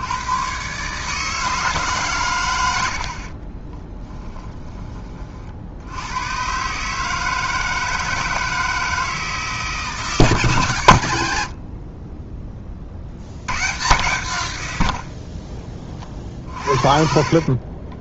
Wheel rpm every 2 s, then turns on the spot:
150, 40, 40, 160, 160, 100, 80, 40, 50.
2-4 10-12 16-18